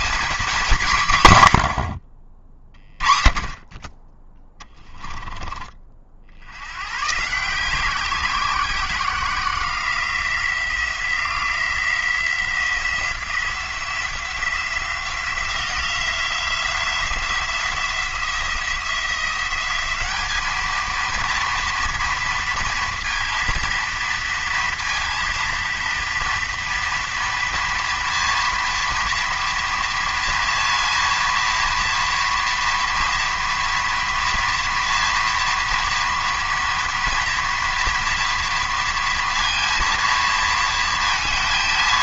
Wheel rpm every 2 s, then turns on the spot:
190, 30, 20, 100, 180, 170, 170, 180, 180, 170, 220, 230, 230, 230, 230, 230, 230, 240, 230, 230, 230.
none